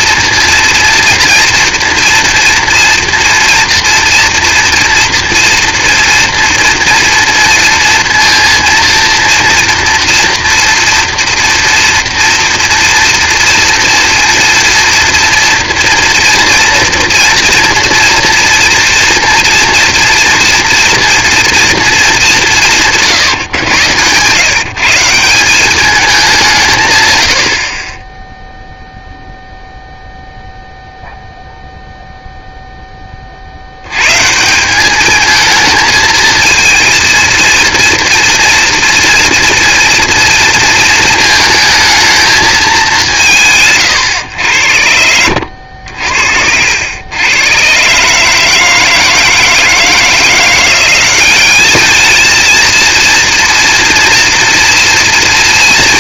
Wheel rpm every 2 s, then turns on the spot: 230, 230, 230, 230, 230, 230, 230, 230, 240, 230, 230, 170, 160, 160, 0, 0, 0, 180, 230, 230, 230, 210, 90, 80, 160, 180, 230, 230.
none